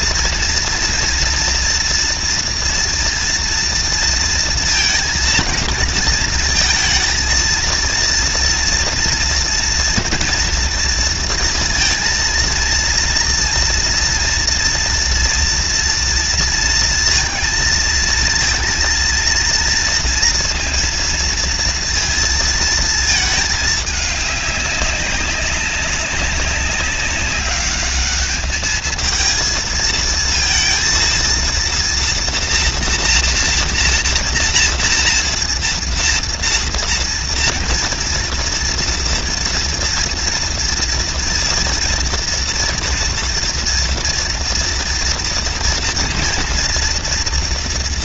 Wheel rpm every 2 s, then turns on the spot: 240, 230, 230, 230, 240, 230, 230, 230, 230, 230, 230, 210, 200, 200, 220, 230, 230, 240, 230, 230, 230, 230, 230, 230.
none